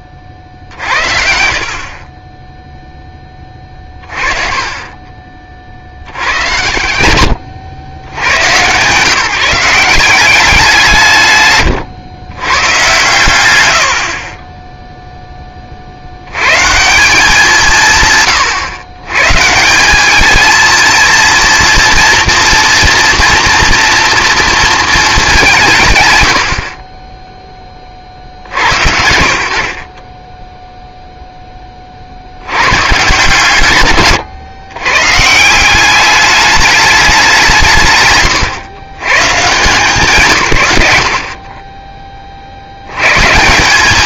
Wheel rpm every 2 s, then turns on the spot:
40, 0, 30, 110, 110, 180, 130, 10, 120, 150, 230, 230, 230, 30, 80, 0, 110, 120, 210, 130, 90, 80.
4-6 12-16